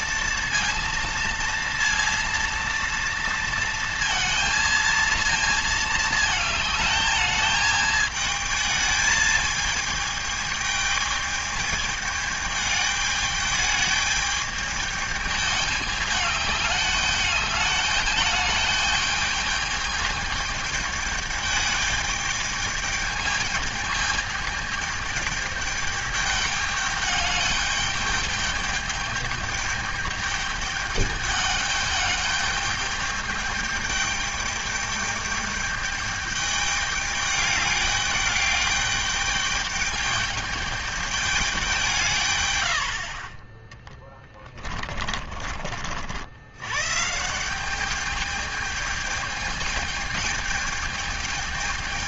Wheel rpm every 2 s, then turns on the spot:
230, 230, 230, 220, 220, 210, 210, 210, 210, 210, 210, 210, 210, 210, 210, 210, 210, 210, 210, 210, 210, 70, 30, 130, 210, 210.
44-46